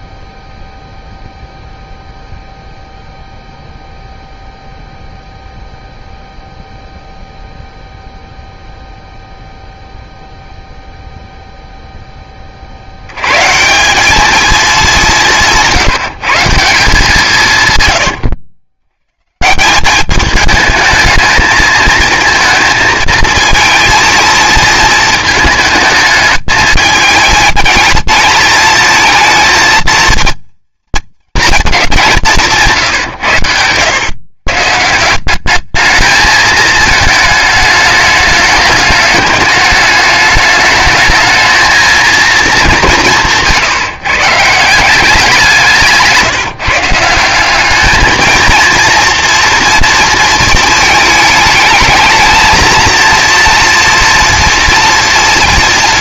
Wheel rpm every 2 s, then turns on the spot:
0, 0, 0, 0, 0, 0, 40, 210, 170, 110, 220, 220, 230, 210, 220, 230, 170, 150, 220, 210, 210, 210, 160, 150, 230, 220, 230, 230.
none